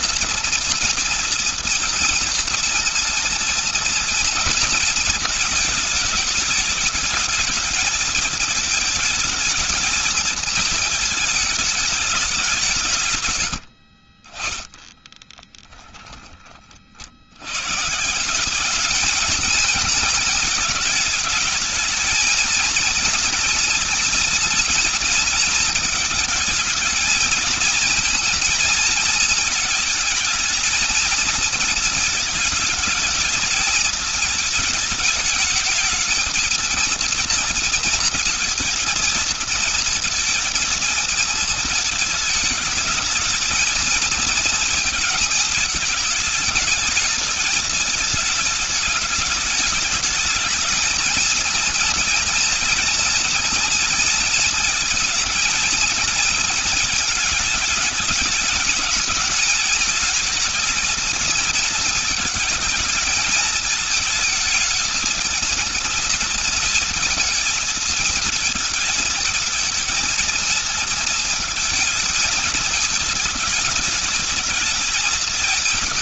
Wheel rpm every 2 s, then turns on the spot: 240, 230, 220, 220, 220, 220, 120, 10, 50, 200, 220, 240, 240, 220, 230, 220, 220, 220, 230, 230, 230, 220, 230, 210, 210, 220, 230, 230, 220, 210, 220, 220, 220, 230, 220, 230, 210, 210.
12-16